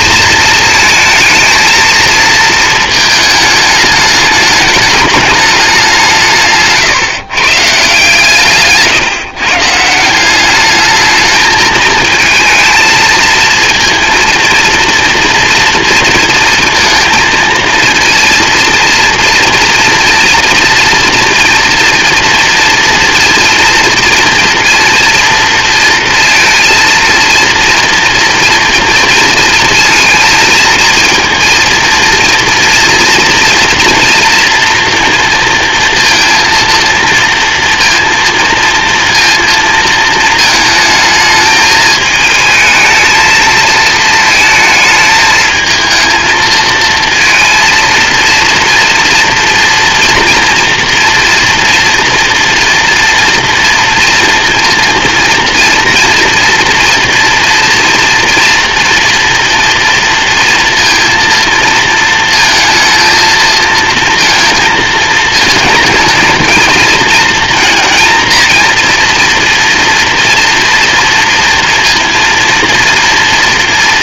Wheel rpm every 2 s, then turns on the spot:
220, 220, 210, 140, 150, 210, 220, 230, 230, 230, 230, 230, 230, 230, 230, 230, 240, 230, 230, 230, 220, 230, 220, 230, 240, 240, 230, 230, 230, 240, 230, 220, 220, 220, 230, 230, 230.
none